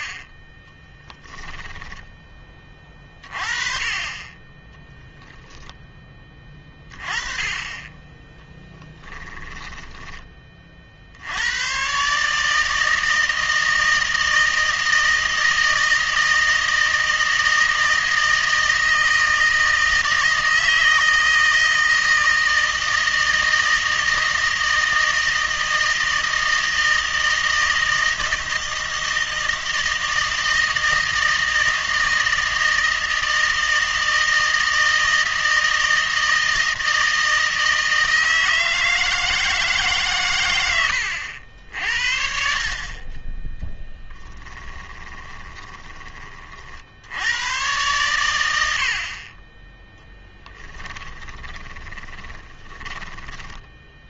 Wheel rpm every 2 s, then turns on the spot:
20, 20, 10, 20, 10, 30, 160, 160, 160, 160, 160, 160, 160, 160, 160, 160, 160, 160, 160, 160, 110, 40, 20, 40, 90, 10, 10.
0-2 8-10 44-46 50-54